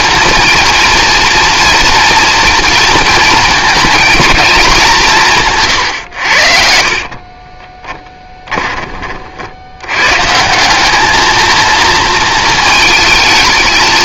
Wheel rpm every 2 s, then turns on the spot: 230, 230, 190, 60, 20, 170, 220.
none